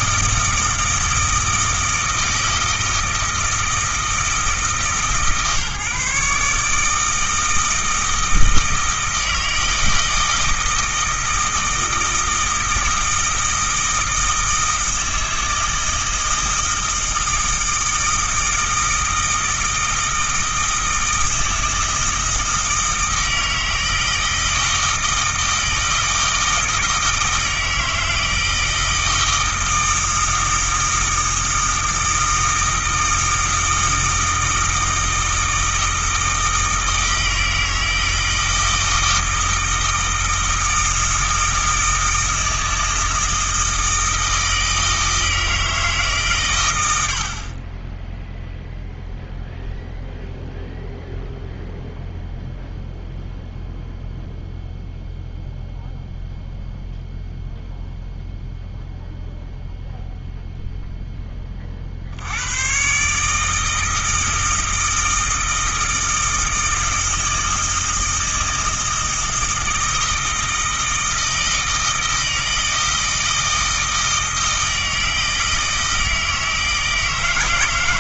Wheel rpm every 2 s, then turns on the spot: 160, 160, 150, 150, 160, 160, 160, 160, 160, 160, 160, 160, 160, 160, 160, 160, 160, 160, 160, 160, 160, 160, 160, 120, 0, 0, 0, 0, 0, 0, 0, 100, 160, 160, 160, 160, 160, 160, 160.
none